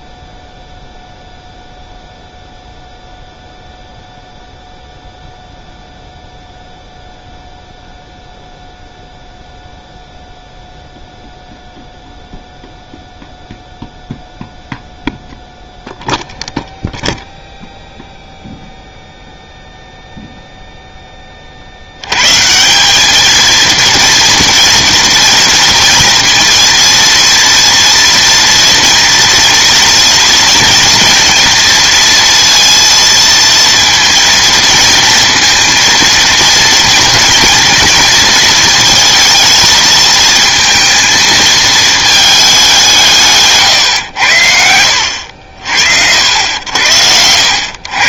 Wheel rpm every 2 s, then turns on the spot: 0, 0, 0, 0, 0, 0, 0, 0, 0, 0, 0, 170, 230, 230, 230, 240, 230, 230, 230, 220, 220, 190, 80, 80.
none